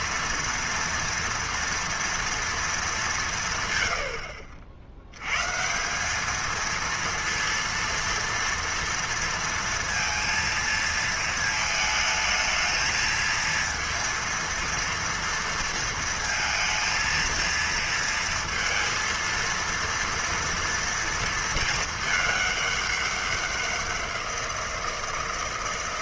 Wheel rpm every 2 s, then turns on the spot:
230, 230, 70, 220, 230, 230, 220, 230, 230, 230, 230, 210, 170.
none